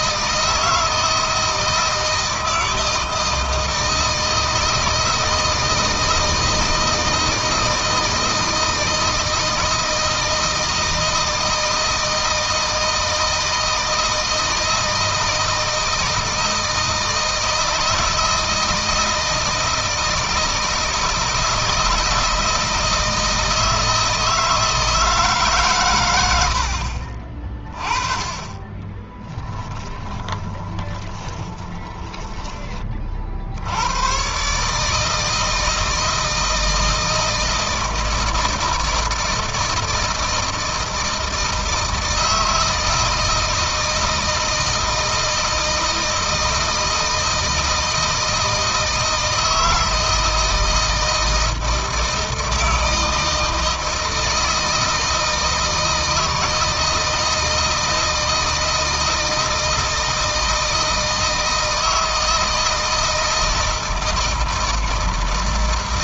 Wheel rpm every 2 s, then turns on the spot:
160, 160, 160, 160, 160, 160, 160, 160, 160, 160, 160, 160, 160, 70, 30, 20, 30, 140, 160, 160, 160, 160, 160, 160, 160, 160, 160, 160, 160, 160, 160, 160, 160.
28-32